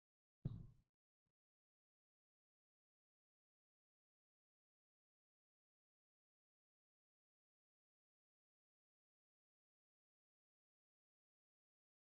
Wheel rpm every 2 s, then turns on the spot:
0, 0, 0, 0, 0, 0.
none